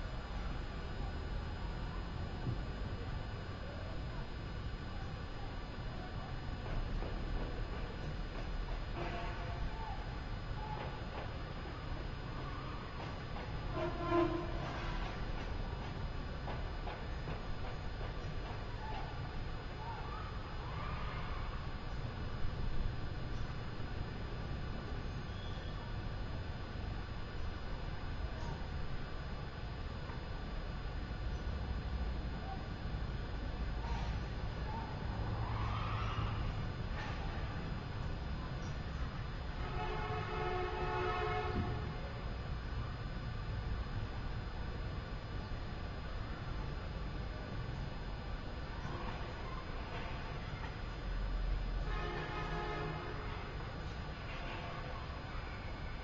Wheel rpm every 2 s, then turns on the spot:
0, 0, 0, 0, 0, 0, 0, 0, 0, 0, 0, 0, 0, 0, 0, 0, 0, 0, 0, 0, 0, 0, 0, 0, 0, 0, 0, 0.
none